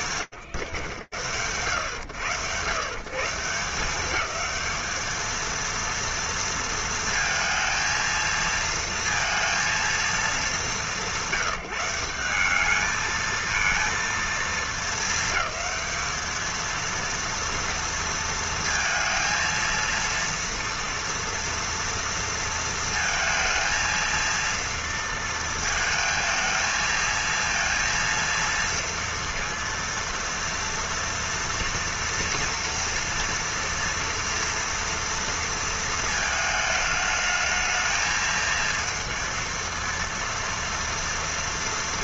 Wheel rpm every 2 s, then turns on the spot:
110, 210, 230, 230, 200, 180, 230, 200, 230, 230, 230, 230, 230, 230, 230, 230, 230, 230, 220, 230, 230.
none